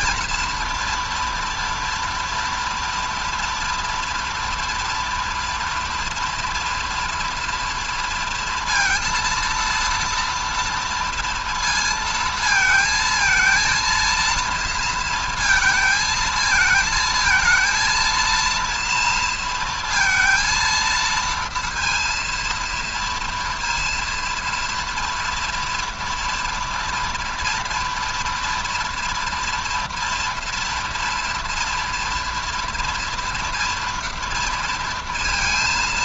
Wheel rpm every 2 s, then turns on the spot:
230, 230, 230, 230, 230, 230, 230, 230, 220, 230, 230, 230, 230, 230, 230, 240, 230, 230.
none